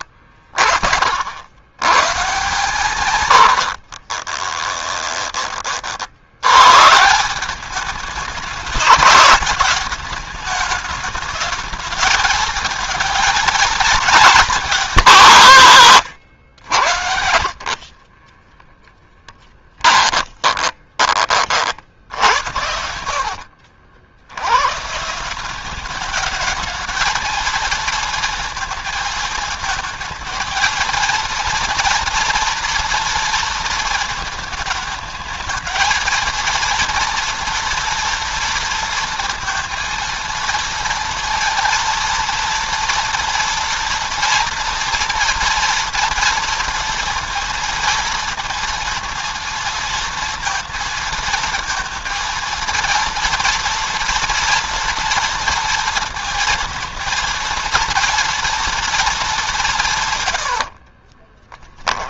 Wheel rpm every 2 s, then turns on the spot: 40, 140, 10, 140, 220, 210, 230, 190, 90, 10, 30, 80, 140, 220, 220, 230, 230, 220, 230, 230, 230, 230, 230, 230, 230, 230, 230, 230, 230, 230, 60.
4-6 18-24 60-62